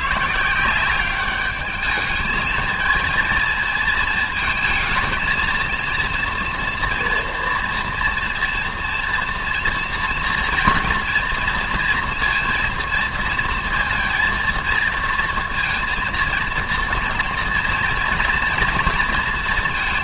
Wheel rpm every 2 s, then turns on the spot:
160, 220, 220, 230, 240, 230, 230, 230, 240, 240.
none